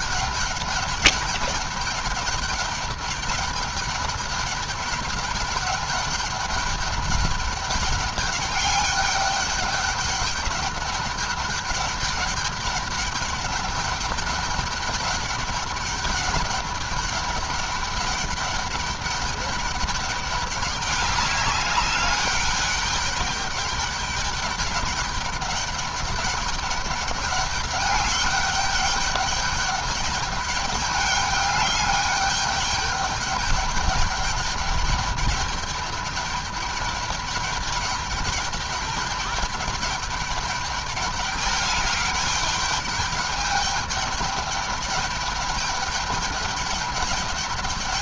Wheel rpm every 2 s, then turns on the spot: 200, 200, 200, 200, 200, 200, 200, 200, 200, 210, 200, 200, 200, 210, 200, 200, 200, 210, 200, 210, 210, 210, 210, 210.
none